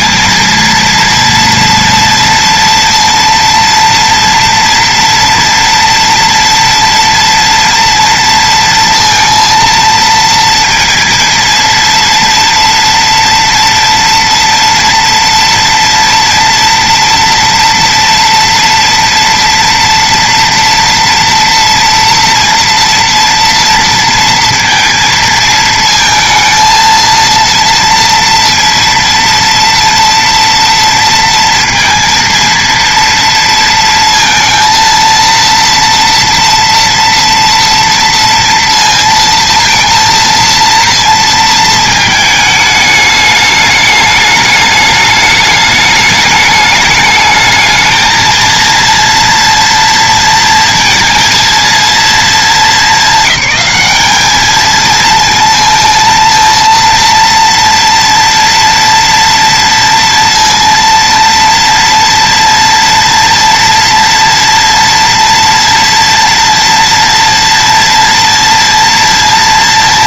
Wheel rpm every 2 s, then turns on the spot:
230, 230, 230, 230, 230, 230, 230, 230, 240, 230, 230, 230, 230, 230, 230, 230, 230, 230, 230, 230, 230, 220, 210, 210, 230, 230, 220, 220, 230, 230, 230, 230, 230, 230, 230.
none